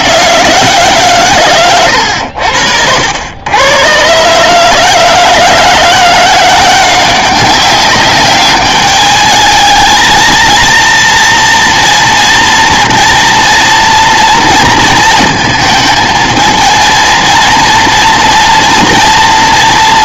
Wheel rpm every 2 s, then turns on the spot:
160, 80, 150, 180, 210, 230, 230, 230, 230, 240.
none